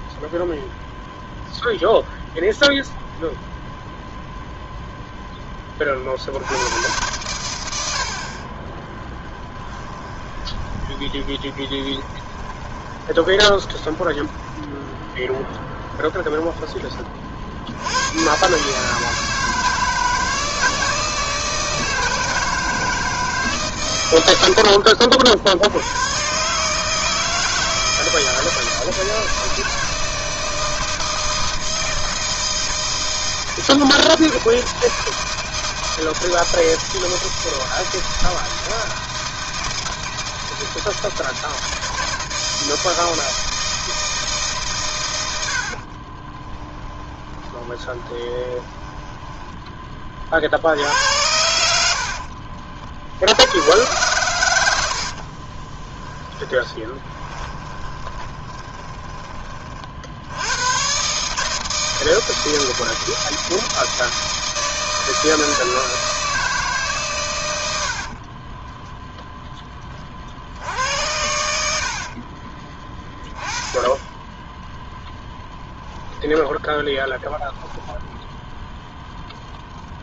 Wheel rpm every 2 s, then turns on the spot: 0, 0, 0, 100, 10, 20, 20, 10, 30, 150, 160, 160, 60, 160, 160, 160, 160, 160, 160, 160, 160, 160, 130, 10, 10, 80, 60, 80, 20, 20, 120, 160, 160, 140, 10, 80, 20, 10, 0, 0.
8-14 24-26 46-50 56-60 68-70